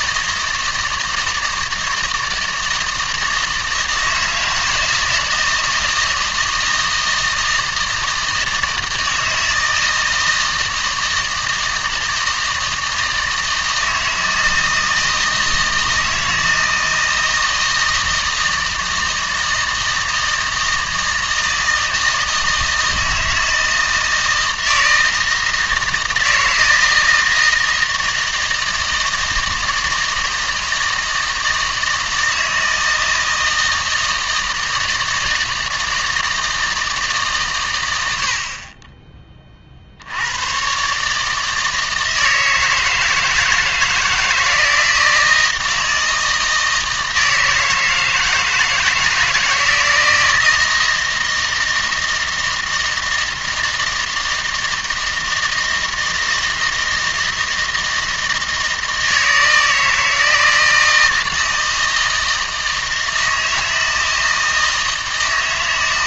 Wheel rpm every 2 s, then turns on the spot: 160, 160, 160, 160, 160, 160, 160, 160, 160, 160, 160, 160, 160, 160, 160, 160, 160, 160, 160, 50, 120, 160, 160, 160, 160, 160, 160, 160, 160, 160, 160, 160, 160.
none